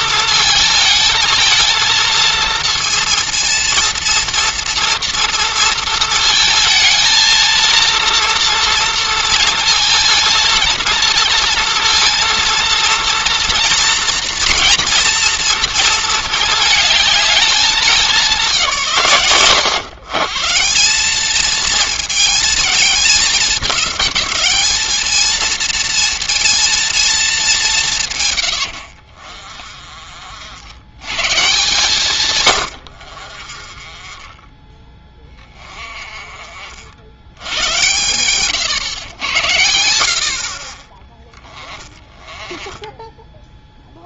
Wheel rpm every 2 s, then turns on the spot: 220, 230, 230, 220, 230, 230, 230, 230, 220, 150, 180, 220, 220, 220, 80, 100, 90, 20, 60, 120, 30, 10.
28-30 32-36 40-44